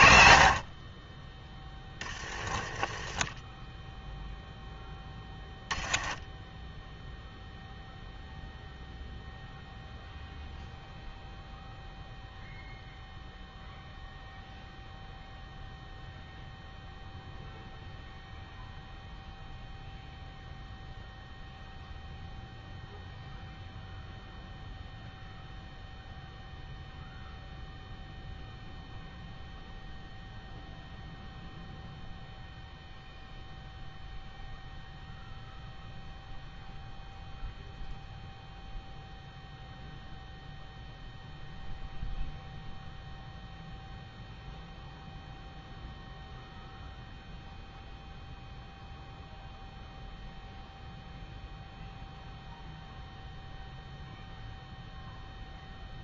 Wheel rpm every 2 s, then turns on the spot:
40, 20, 10, 0, 0, 0, 0, 0, 0, 0, 0, 0, 0, 0, 0, 0, 0, 0, 0, 0, 0, 0, 0, 0, 0, 0, 0, 0.
none